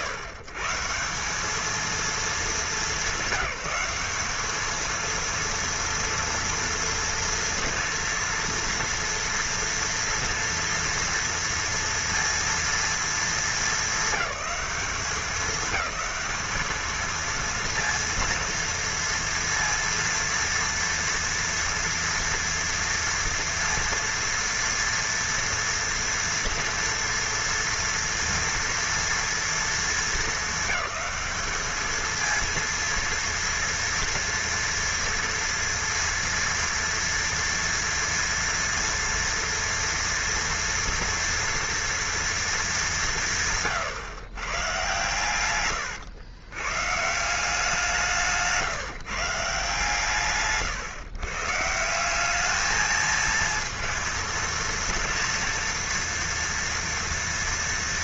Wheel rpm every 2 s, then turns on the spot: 140, 210, 220, 230, 230, 230, 240, 210, 220, 230, 230, 230, 230, 230, 230, 220, 230, 230, 230, 230, 230, 200, 130, 130, 150, 140, 220, 230, 240.
none